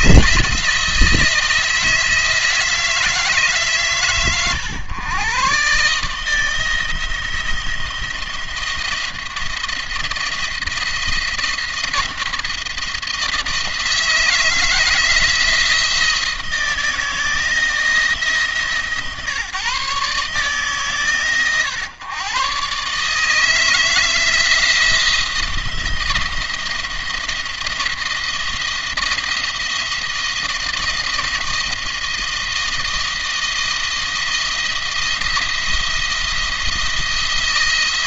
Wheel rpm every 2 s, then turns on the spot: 160, 160, 120, 160, 170, 170, 170, 160, 160, 150, 150, 130, 170, 170, 170, 160, 170, 160, 170.
none